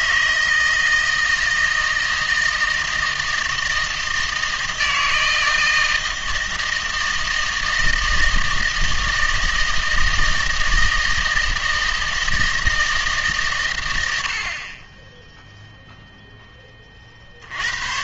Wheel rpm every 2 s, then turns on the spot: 160, 160, 160, 160, 160, 160, 160, 30, 30.
none